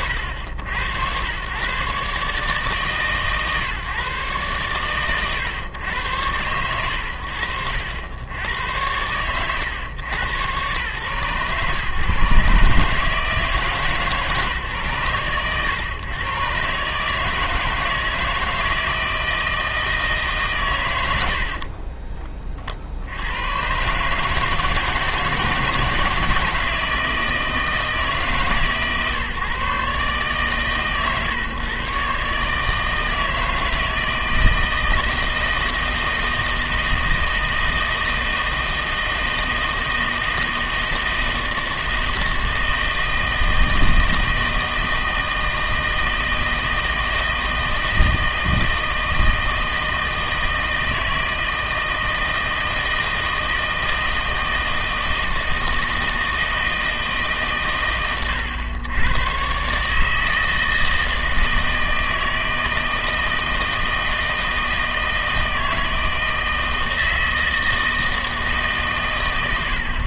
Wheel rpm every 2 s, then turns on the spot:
80, 150, 110, 90, 100, 100, 140, 130, 140, 160, 130, 50, 160, 160, 140, 130, 160, 160, 160, 160, 160, 160, 160, 160, 160, 160, 160, 160, 160, 100, 160, 160, 160, 160, 140.
none